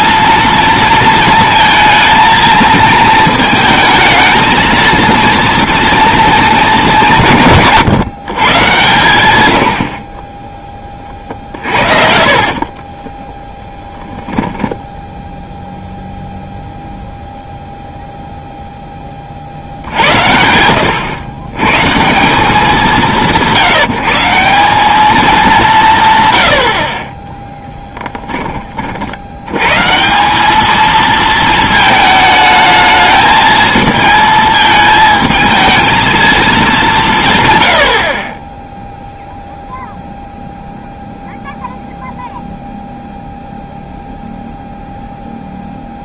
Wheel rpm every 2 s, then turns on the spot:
230, 220, 220, 210, 130, 20, 40, 10, 0, 0, 90, 180, 190, 70, 30, 210, 220, 220, 200, 10, 0, 0, 0.
12-14